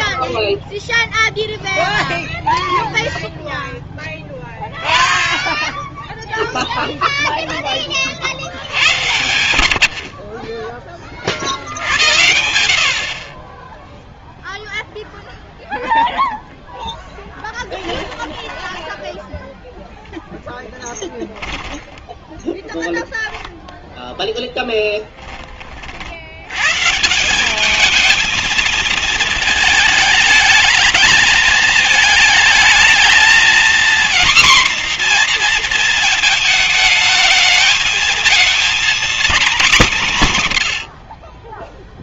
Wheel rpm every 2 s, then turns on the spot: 0, 0, 0, 0, 90, 20, 60, 0, 10, 10, 10, 0, 0, 140, 220, 210, 220, 250, 220, 240, 90.
16-22